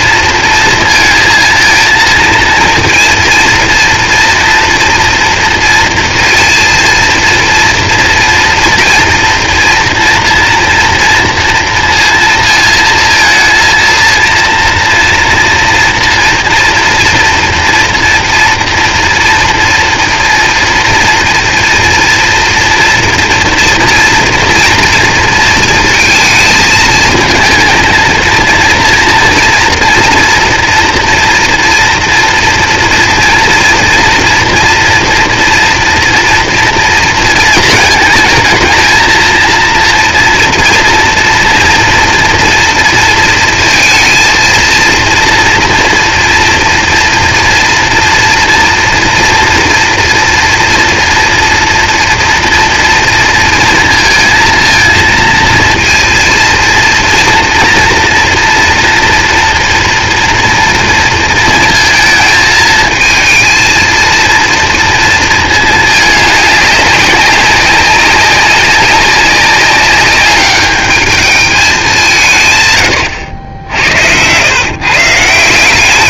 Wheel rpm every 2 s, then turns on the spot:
230, 230, 230, 230, 230, 230, 220, 230, 230, 230, 230, 230, 230, 220, 230, 230, 230, 230, 230, 220, 230, 230, 230, 230, 230, 230, 230, 230, 230, 240, 230, 220, 230, 210, 190, 210, 100, 140.
none